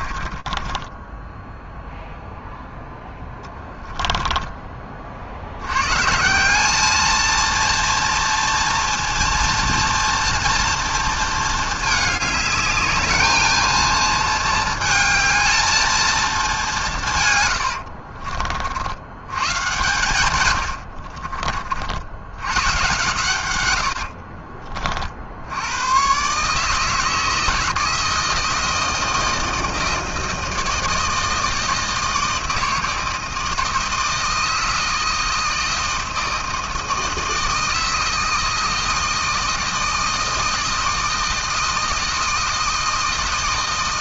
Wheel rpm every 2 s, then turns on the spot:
20, 0, 20, 190, 230, 230, 210, 230, 200, 50, 110, 110, 50, 150, 160, 160, 160, 160, 160, 160, 160, 160.
0-2 20-22 24-26